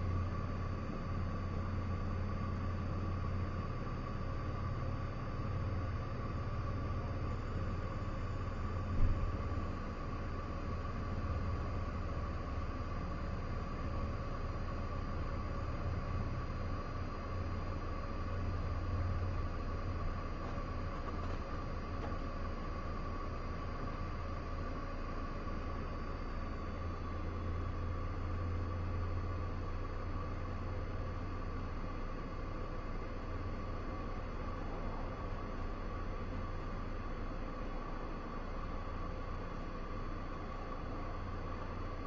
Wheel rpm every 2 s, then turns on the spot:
0, 0, 0, 0, 0, 0, 0, 0, 0, 0, 0, 0, 0, 0, 0, 0, 0, 0, 0, 0, 0.
none